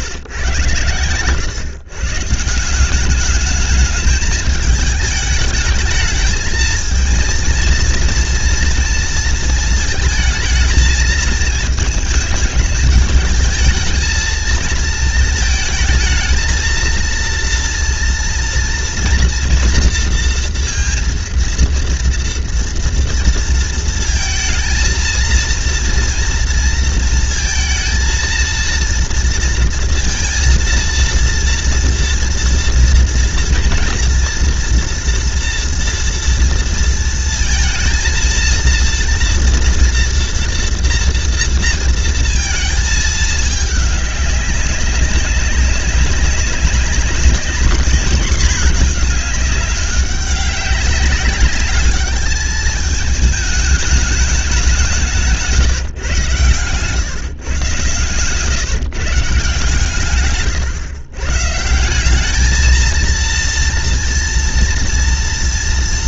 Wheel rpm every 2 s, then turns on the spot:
140, 150, 220, 220, 230, 220, 220, 220, 220, 230, 230, 230, 230, 230, 230, 230, 230, 240, 230, 230, 230, 230, 200, 200, 210, 200, 210, 200, 120, 120, 120, 200, 230.
none